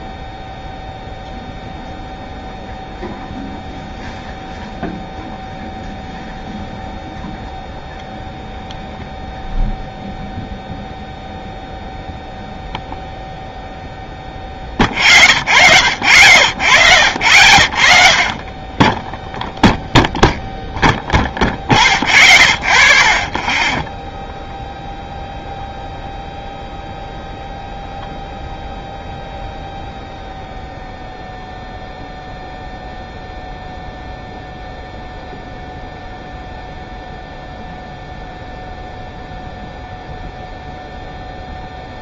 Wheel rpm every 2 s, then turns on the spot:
0, 0, 0, 0, 0, 0, 0, 0, 0, 0, 0, 0, 0, 0, 0, 0, 0, 0, 0, 0, 0.
none